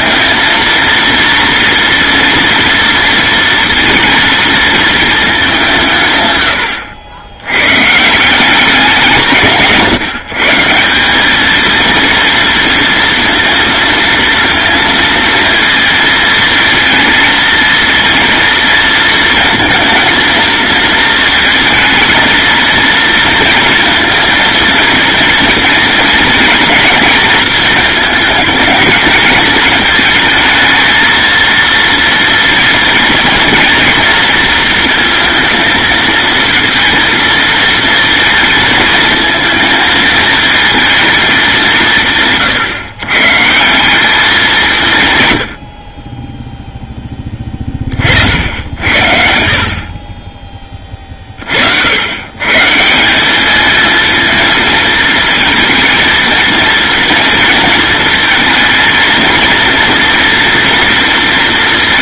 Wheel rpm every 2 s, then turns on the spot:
230, 230, 230, 80, 180, 180, 230, 230, 230, 230, 230, 230, 230, 230, 220, 220, 230, 230, 230, 220, 220, 140, 150, 10, 60, 30, 170, 230, 230, 230, 230.
none